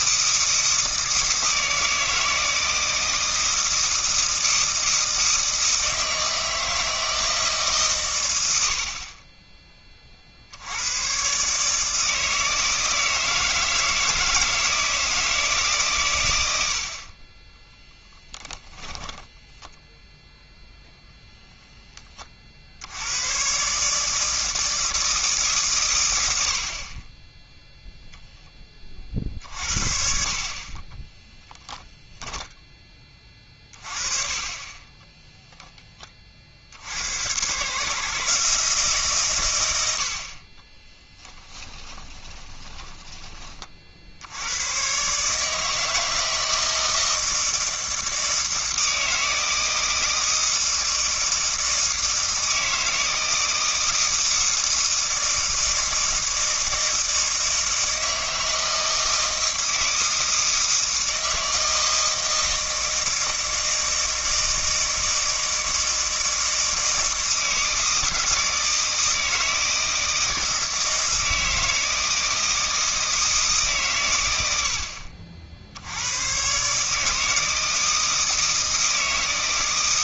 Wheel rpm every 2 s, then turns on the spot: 160, 160, 160, 160, 70, 90, 160, 160, 80, 10, 0, 70, 160, 60, 30, 30, 20, 20, 60, 150, 30, 10, 110, 160, 160, 160, 160, 160, 160, 160, 160, 160, 160, 160, 160, 160, 160, 80, 140, 160.
18-20 30-32 40-44